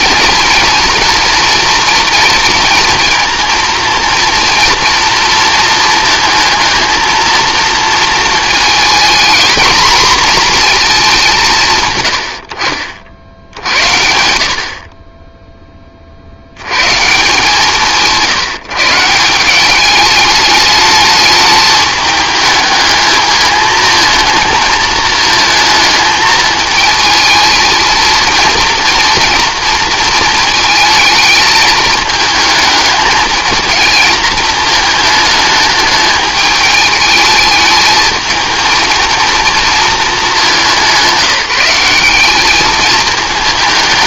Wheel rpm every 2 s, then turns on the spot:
230, 230, 240, 220, 230, 220, 60, 40, 120, 160, 210, 220, 220, 220, 230, 220, 210, 220, 210, 230, 190, 220.
none